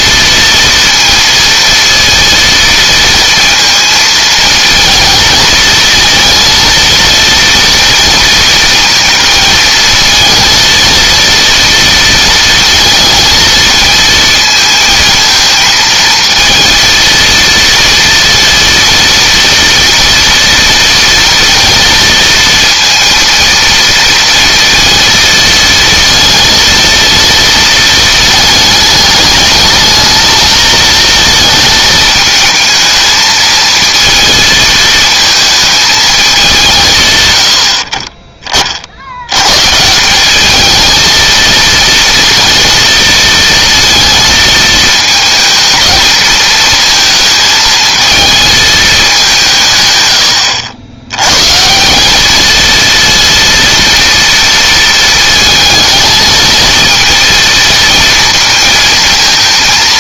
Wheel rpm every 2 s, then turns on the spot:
230, 230, 220, 230, 230, 230, 230, 220, 230, 230, 230, 230, 230, 230, 210, 230, 220, 220, 160, 60, 220, 230, 220, 220, 210, 100, 230, 230, 220, 230.
none